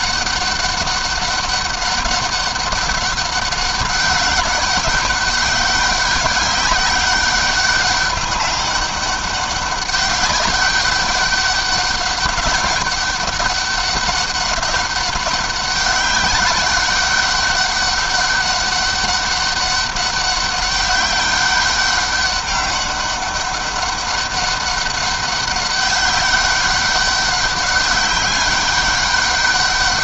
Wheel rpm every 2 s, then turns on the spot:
200, 200, 200, 190, 200, 200, 200, 200, 190, 200, 200, 200, 200, 200, 200.
none